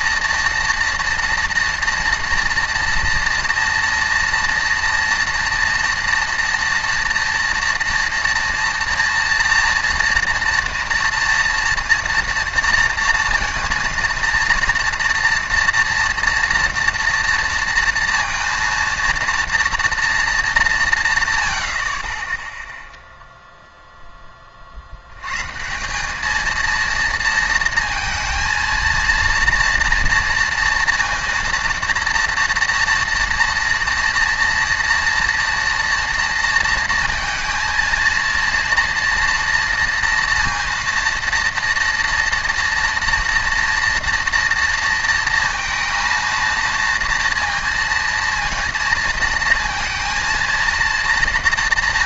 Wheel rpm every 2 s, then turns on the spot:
230, 230, 230, 230, 230, 230, 230, 230, 230, 230, 200, 0, 20, 220, 230, 230, 230, 230, 230, 230, 230, 240, 230, 230, 230, 230.
none